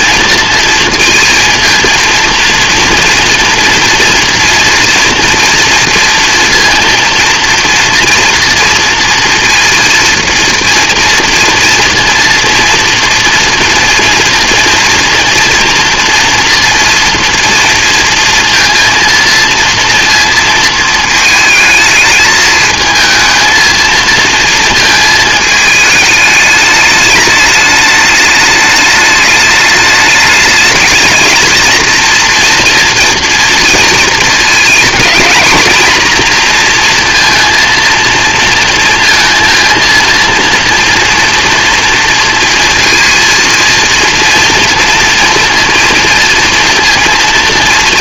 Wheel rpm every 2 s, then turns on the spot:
230, 230, 230, 230, 230, 230, 230, 230, 230, 230, 220, 220, 230, 210, 210, 220, 230, 230, 230, 230, 230, 230, 230, 230.
none